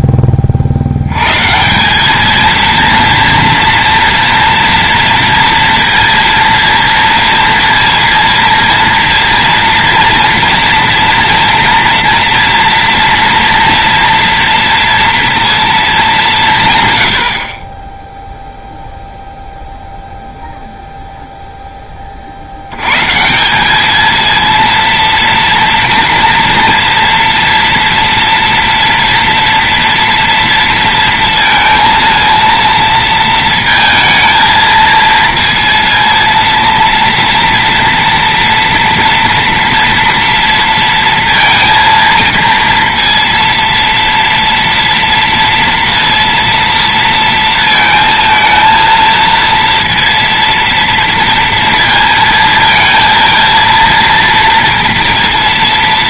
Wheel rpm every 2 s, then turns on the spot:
60, 230, 230, 230, 230, 230, 230, 230, 170, 0, 0, 90, 230, 230, 230, 230, 230, 230, 230, 230, 230, 230, 230, 230, 230, 230, 230, 230.
none